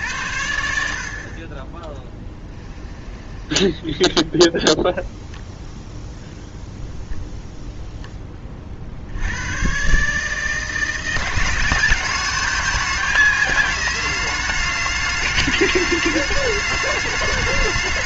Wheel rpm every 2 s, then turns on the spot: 60, 20, 0, 0, 50, 160, 210, 210, 210.
2-4